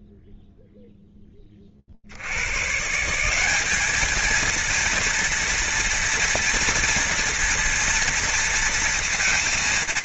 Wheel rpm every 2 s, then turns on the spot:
0, 90, 230, 230, 230.
none